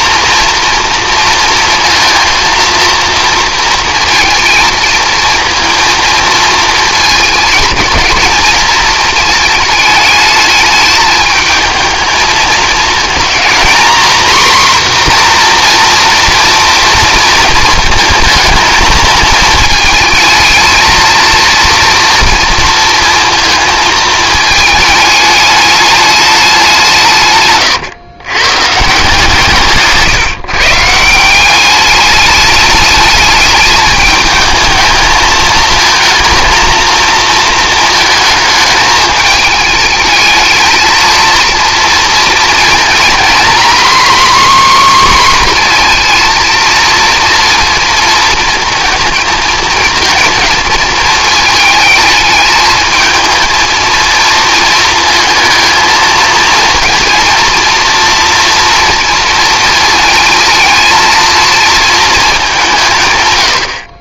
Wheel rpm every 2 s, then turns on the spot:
230, 230, 230, 230, 220, 220, 220, 250, 230, 220, 220, 230, 210, 180, 140, 140, 210, 220, 230, 220, 220, 230, 270, 230, 230, 220, 220, 230, 230, 230, 230, 190.
none